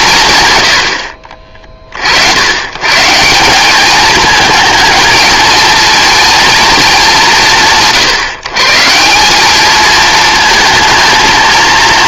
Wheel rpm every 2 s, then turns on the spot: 90, 130, 220, 220, 150, 220.
none